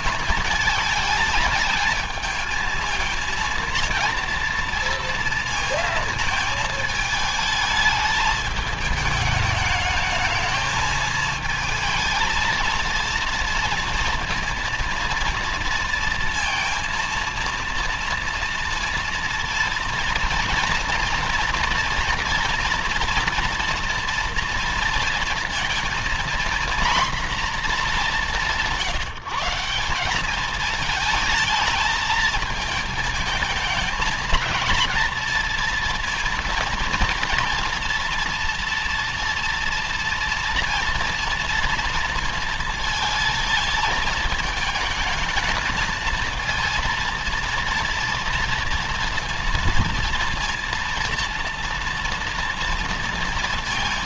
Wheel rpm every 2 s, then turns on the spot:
220, 220, 230, 220, 210, 220, 230, 230, 230, 230, 230, 230, 230, 240, 180, 210, 220, 220, 230, 230, 230, 230, 220, 230, 230, 230, 230.
none